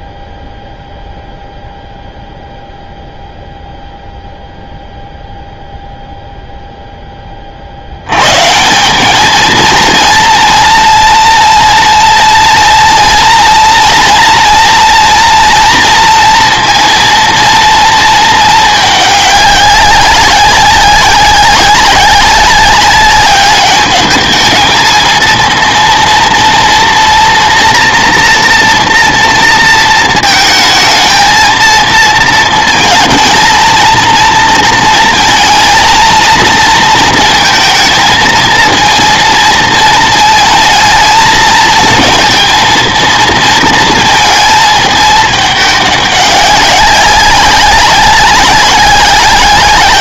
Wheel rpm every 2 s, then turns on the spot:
0, 0, 0, 0, 160, 230, 230, 230, 230, 220, 190, 190, 220, 230, 240, 220, 230, 230, 230, 220, 220, 230, 220, 200, 190.
none